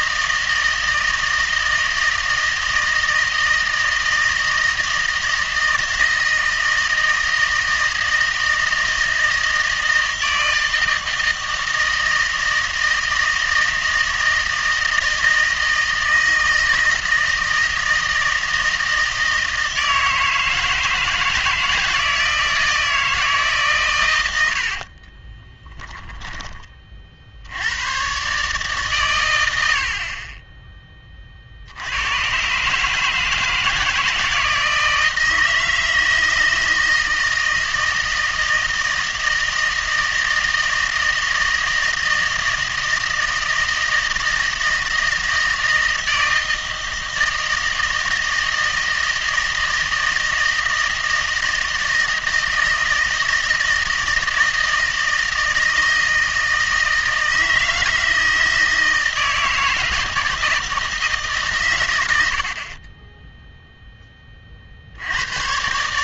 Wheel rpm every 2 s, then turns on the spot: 160, 160, 160, 160, 160, 160, 160, 160, 160, 160, 160, 160, 60, 30, 140, 20, 140, 160, 160, 160, 160, 160, 160, 160, 160, 160, 160, 160, 160, 160, 160, 40, 60.
24-26